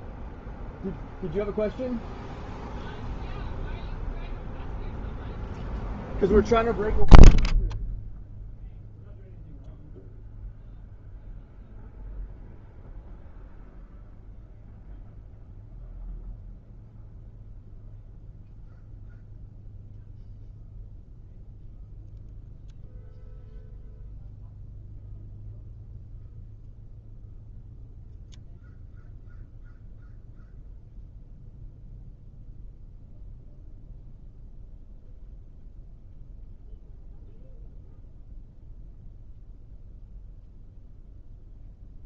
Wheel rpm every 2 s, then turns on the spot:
0, 0, 0, 0, 0, 0, 0, 0, 0, 0, 0, 0, 0, 0, 0, 0, 0, 0, 0, 0, 0.
none